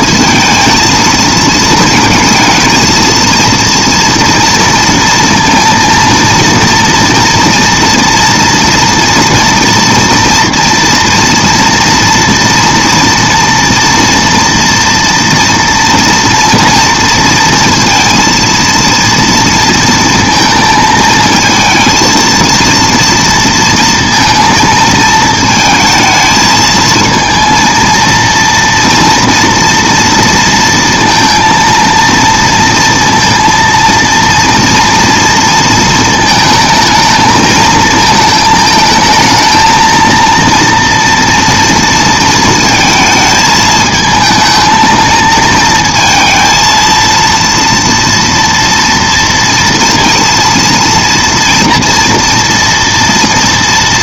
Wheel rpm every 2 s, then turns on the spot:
230, 230, 230, 230, 230, 230, 230, 230, 230, 230, 220, 230, 220, 230, 230, 230, 230, 230, 220, 220, 230, 220, 220, 230, 230, 230, 230.
none